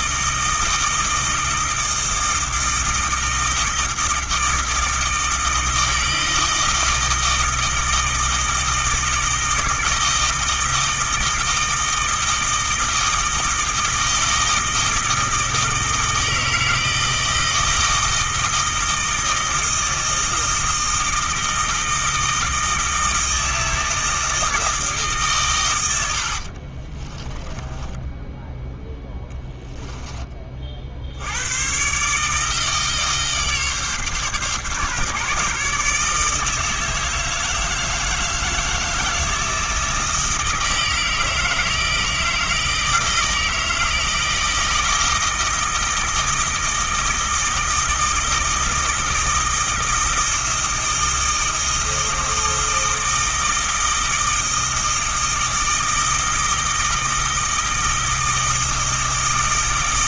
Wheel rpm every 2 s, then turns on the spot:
160, 160, 160, 160, 160, 160, 160, 160, 160, 160, 160, 160, 160, 30, 0, 50, 160, 140, 160, 160, 160, 160, 160, 160, 160, 160, 160, 160, 160, 160.
26-28